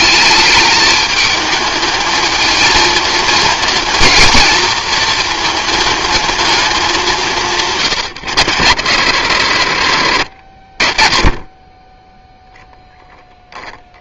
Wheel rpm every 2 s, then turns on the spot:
210, 220, 220, 200, 110, 30, 0.
none